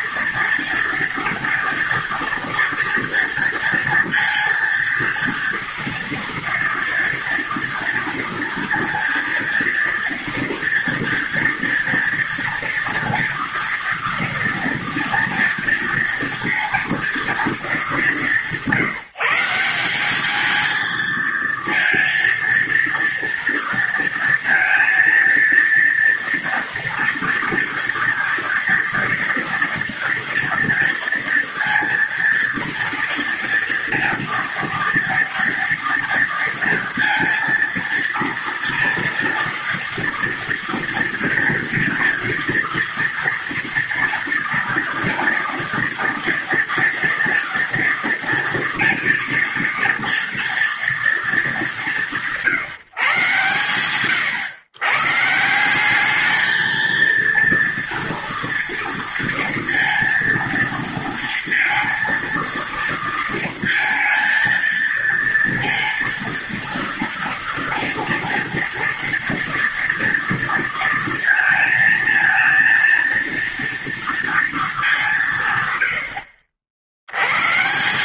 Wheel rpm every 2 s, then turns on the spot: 230, 230, 230, 230, 230, 230, 230, 230, 230, 160, 230, 230, 230, 230, 230, 230, 230, 230, 230, 230, 230, 230, 240, 240, 230, 230, 140, 120, 230, 230, 230, 230, 230, 230, 230, 230, 230, 200, 90.
none